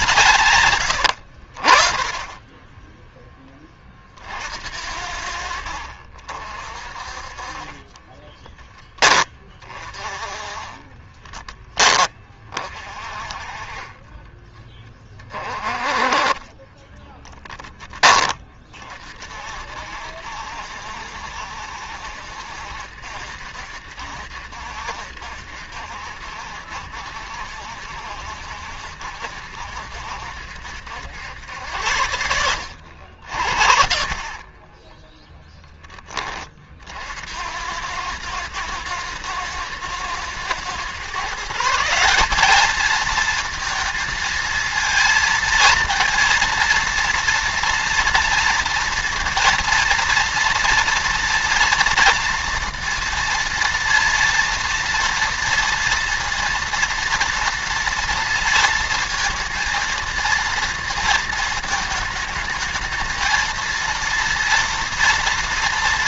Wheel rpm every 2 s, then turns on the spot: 140, 10, 60, 60, 20, 20, 30, 20, 20, 30, 70, 70, 70, 70, 60, 70, 80, 50, 30, 110, 120, 210, 230, 230, 230, 230, 230, 230, 230, 230, 230, 220, 230.
0-2 10-12 34-36